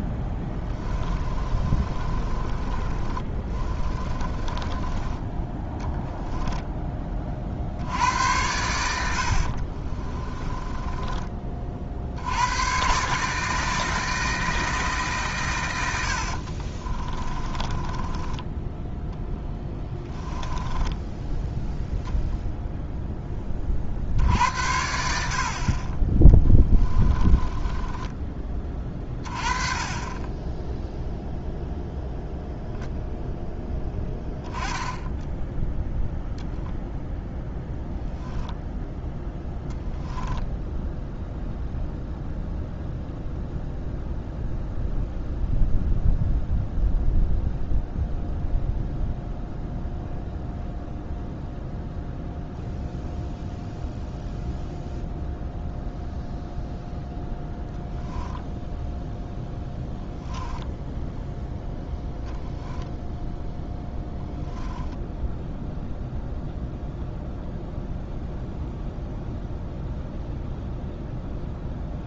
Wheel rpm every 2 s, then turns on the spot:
10, 20, 20, 10, 80, 20, 120, 160, 40, 10, 10, 0, 90, 20, 20, 10, 0, 10, 0, 0, 0, 0, 0, 0, 0, 0, 0, 0, 0, 0, 0, 0, 10, 0, 0, 0.
0-6 10-12 16-22 26-28 64-66